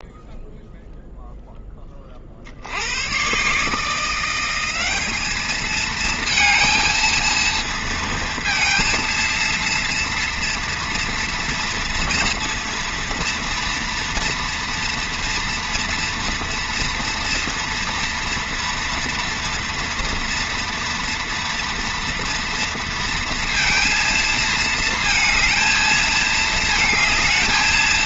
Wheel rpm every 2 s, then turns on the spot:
0, 20, 150, 220, 230, 230, 230, 230, 230, 230, 240, 230, 230, 220.
none